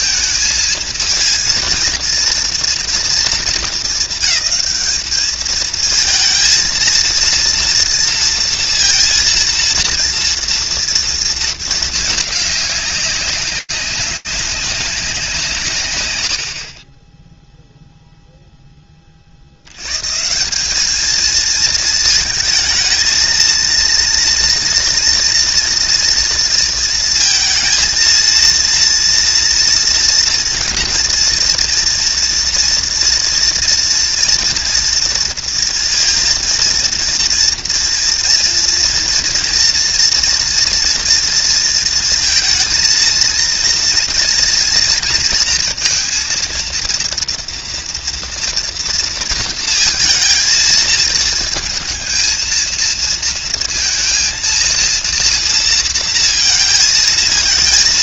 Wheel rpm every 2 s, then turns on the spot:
230, 230, 220, 220, 230, 230, 200, 200, 40, 20, 210, 220, 230, 230, 230, 230, 230, 240, 230, 230, 240, 230, 230, 230, 230, 230, 230, 230, 220.
none